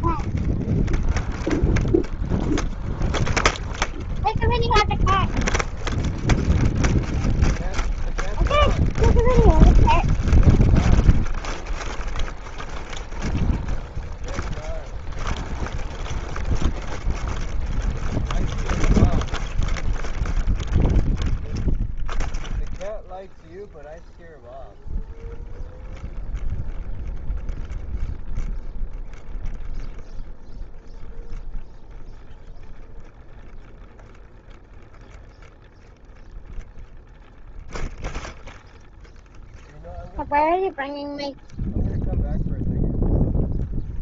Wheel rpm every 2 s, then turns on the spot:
0, 0, 0, 0, 0, 0, 0, 0, 0, 0, 0, 0, 0, 0, 0, 0, 0, 0, 0, 0, 0, 0.
none